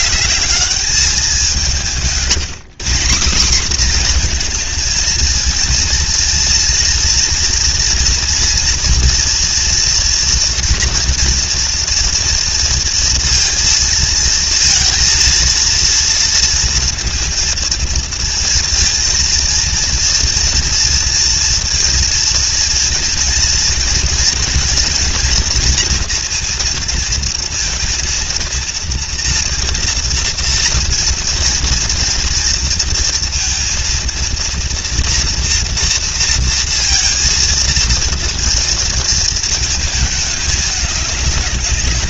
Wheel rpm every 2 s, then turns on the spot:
210, 180, 230, 230, 240, 230, 230, 230, 230, 230, 230, 230, 230, 230, 230, 230, 230, 230, 230, 230, 210.
none